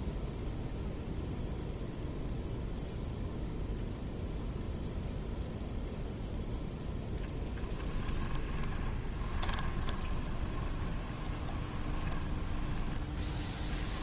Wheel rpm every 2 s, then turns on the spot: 0, 0, 0, 10, 20, 20, 10.
8-14